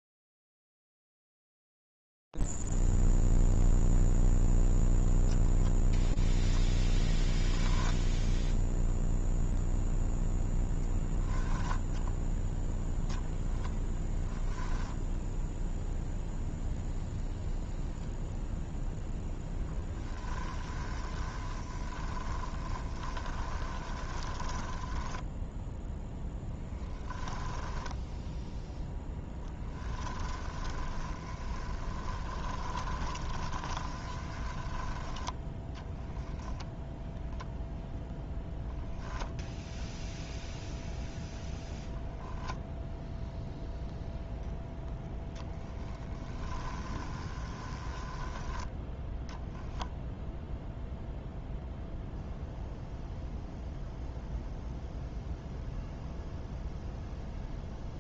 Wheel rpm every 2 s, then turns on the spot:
0, 0, 0, 0, 0, 0, 0, 0, 0, 0, 20, 20, 10, 0, 0, 10, 20, 20, 0, 0, 0, 0, 0, 10, 10, 0, 0, 0, 0.
20-26 30-36 46-50